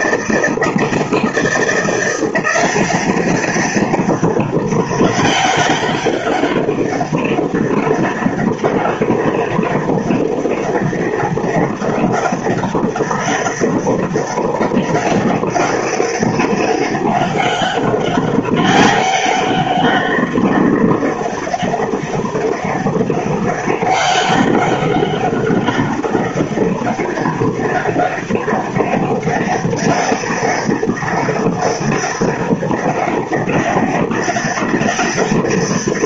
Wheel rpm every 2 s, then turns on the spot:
160, 180, 200, 200, 200, 200, 200, 200, 200, 200, 200, 200, 200, 200, 200, 200, 200, 200.
none